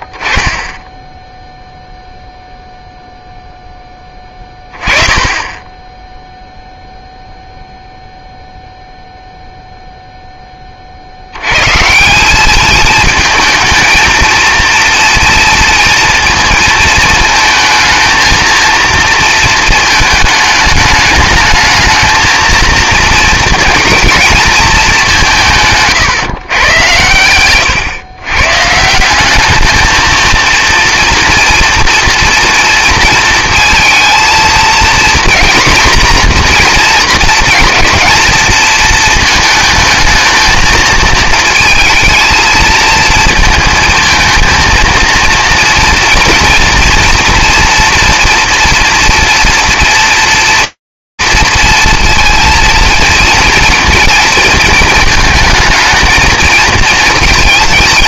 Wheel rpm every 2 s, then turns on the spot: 30, 0, 20, 0, 0, 10, 200, 230, 230, 230, 210, 230, 220, 120, 130, 230, 230, 230, 240, 230, 220, 230, 220, 230, 230, 230, 230, 220, 230.
none